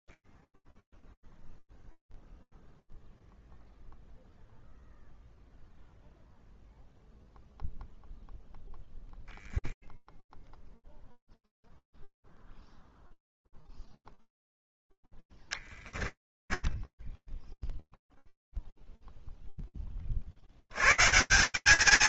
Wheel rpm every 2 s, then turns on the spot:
0, 0, 0, 0, 0, 0, 0, 0, 10, 0, 30.
16-18